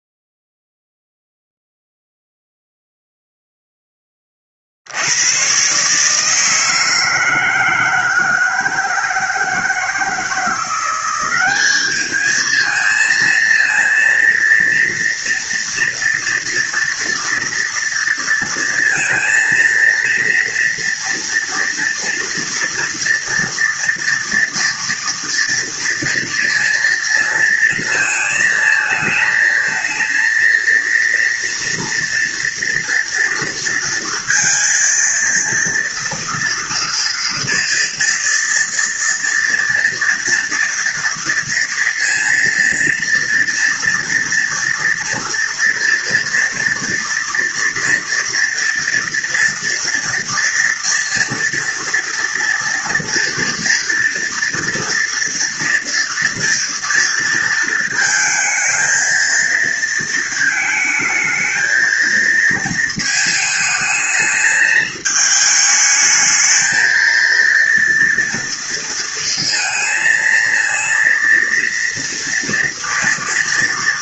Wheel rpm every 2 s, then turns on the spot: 0, 0, 110, 160, 160, 190, 230, 230, 230, 230, 230, 230, 230, 230, 220, 230, 230, 230, 230, 240, 230, 230, 230, 240, 230, 240, 230, 240, 230, 220, 220, 220, 220, 230, 230, 230, 230.
none